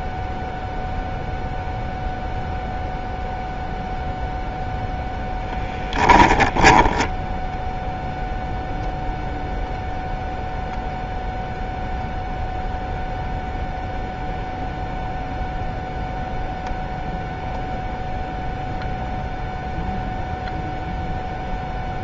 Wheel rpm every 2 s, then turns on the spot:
0, 0, 0, 20, 0, 0, 0, 0, 0, 0, 0.
6-8